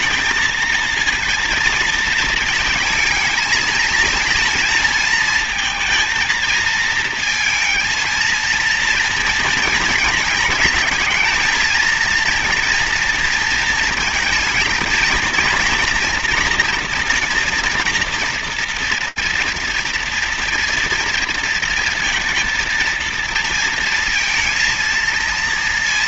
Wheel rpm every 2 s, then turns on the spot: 220, 220, 230, 230, 230, 220, 230, 230, 230, 230, 230, 230, 230.
none